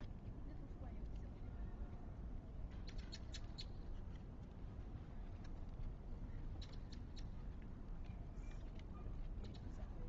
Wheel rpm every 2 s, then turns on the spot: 0, 0, 0, 0, 0.
none